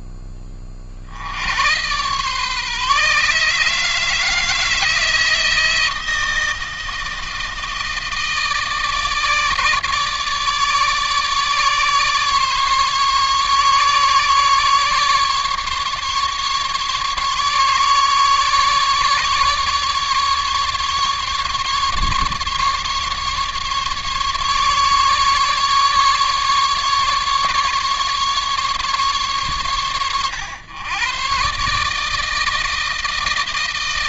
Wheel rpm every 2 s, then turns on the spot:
50, 140, 160, 160, 150, 150, 140, 150, 140, 140, 150, 150, 140, 140, 140, 120, 160.
none